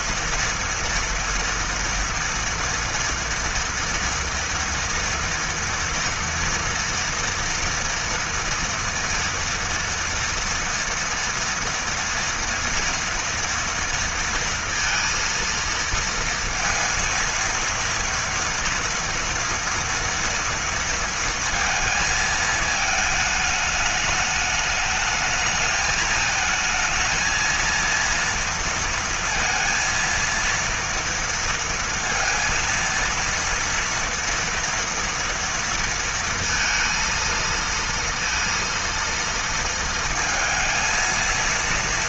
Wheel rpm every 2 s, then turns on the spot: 240, 230, 230, 230, 230, 230, 230, 230, 230, 230, 230, 220, 210, 220, 230, 230, 230, 230, 230, 230, 230.
none